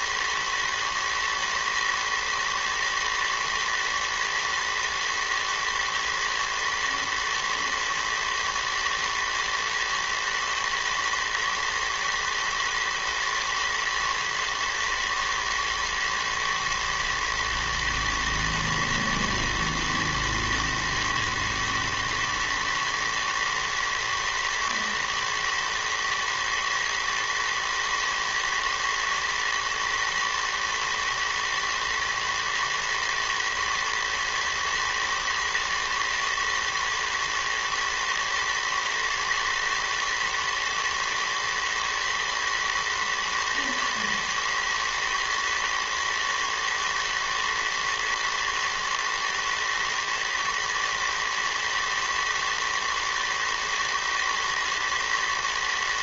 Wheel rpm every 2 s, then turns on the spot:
110, 110, 120, 110, 110, 110, 110, 110, 110, 120, 110, 110, 120, 110, 110, 110, 110, 110, 110, 110, 110, 110, 110, 110, 120, 110, 110, 120.
none